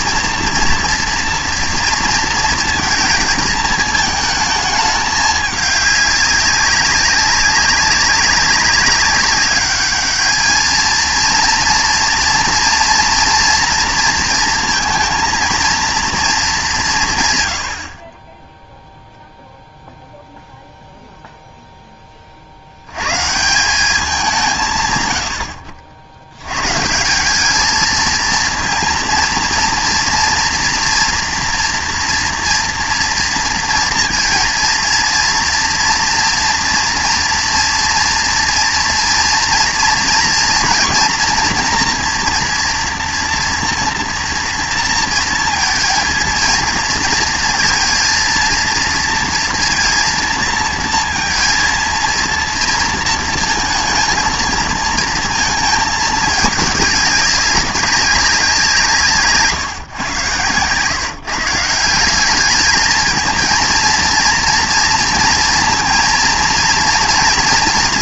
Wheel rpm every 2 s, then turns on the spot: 230, 220, 220, 190, 190, 220, 230, 230, 200, 10, 0, 70, 150, 140, 230, 230, 230, 230, 230, 230, 230, 230, 230, 230, 230, 230, 230, 230, 210, 170, 130, 210, 230, 230.
none